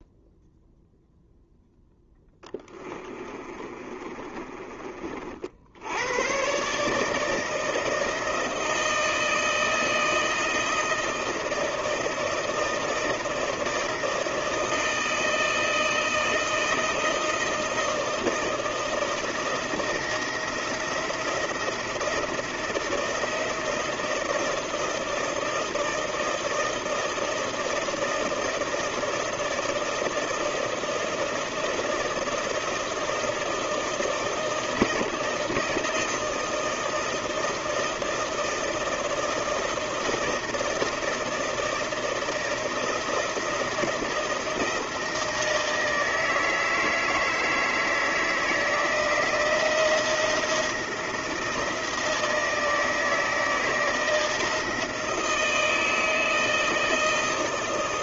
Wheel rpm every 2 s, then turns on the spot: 0, 20, 40, 150, 160, 160, 160, 160, 160, 160, 170, 160, 160, 160, 160, 160, 160, 160, 160, 160, 160, 170, 160, 160, 160, 160, 160, 160, 160.
2-4